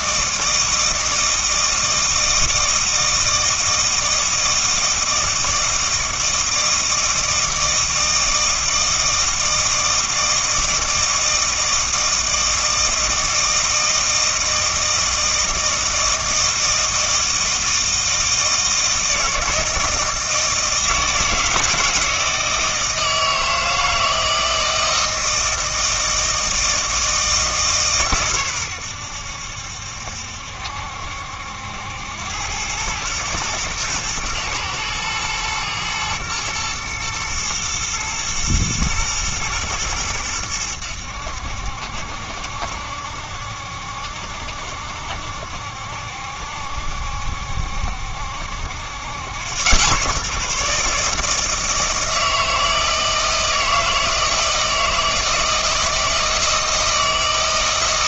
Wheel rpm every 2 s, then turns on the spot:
160, 160, 160, 160, 160, 160, 160, 160, 160, 160, 160, 160, 160, 160, 110, 70, 100, 110, 110, 110, 90, 70, 70, 70, 80, 150, 160, 160, 160.
none